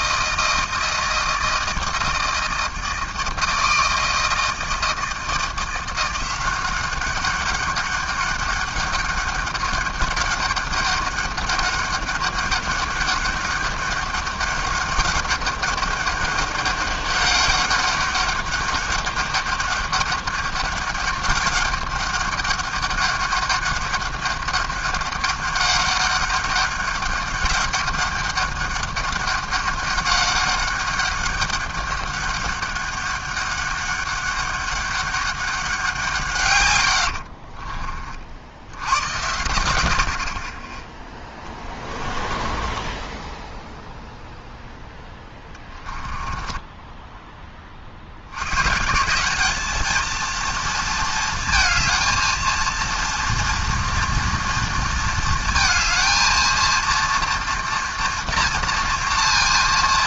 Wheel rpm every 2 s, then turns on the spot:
160, 160, 160, 190, 200, 200, 200, 200, 200, 200, 200, 200, 200, 200, 200, 200, 200, 200, 120, 80, 20, 20, 0, 10, 120, 230, 230, 230, 230, 230.
36-38 42-44 46-48